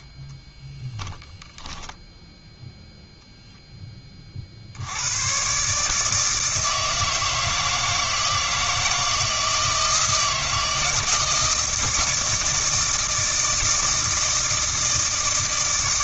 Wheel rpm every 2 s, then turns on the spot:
0, 0, 70, 160, 160, 160, 170, 160.
none